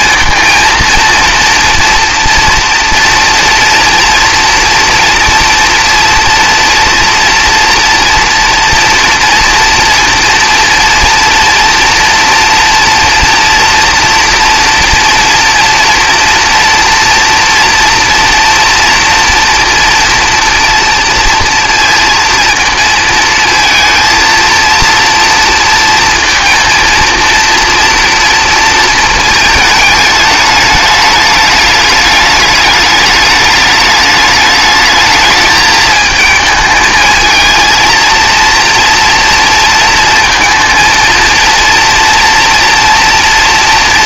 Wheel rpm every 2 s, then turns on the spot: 230, 230, 230, 230, 230, 230, 230, 230, 240, 230, 230, 230, 230, 230, 230, 210, 210, 210, 220, 230, 230, 230.
none